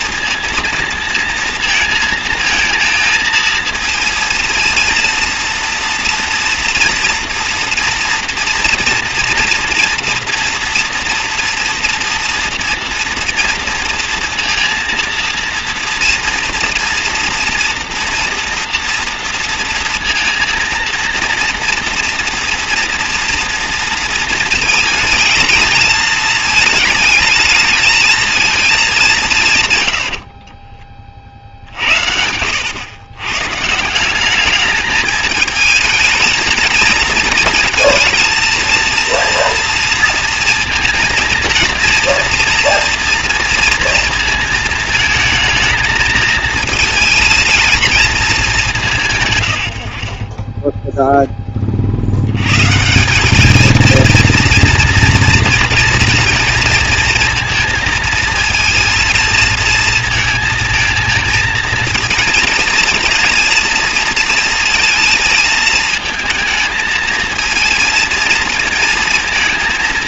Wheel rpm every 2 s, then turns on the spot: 230, 230, 230, 230, 230, 240, 240, 230, 240, 230, 230, 230, 230, 220, 210, 30, 110, 210, 230, 230, 230, 230, 220, 230, 180, 10, 160, 230, 230, 230, 230, 230, 220, 220, 230.
none